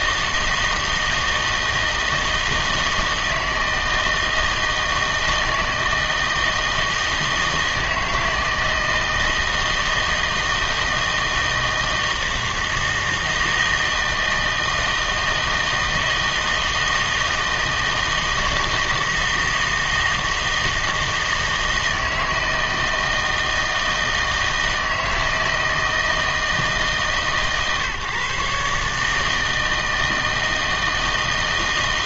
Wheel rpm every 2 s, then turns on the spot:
160, 160, 160, 160, 160, 160, 160, 160, 160, 160, 160, 160, 160, 160, 150, 160.
none